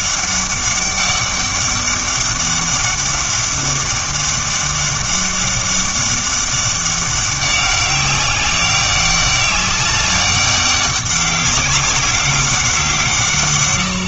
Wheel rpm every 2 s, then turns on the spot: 200, 200, 200, 200, 200, 200, 180.
none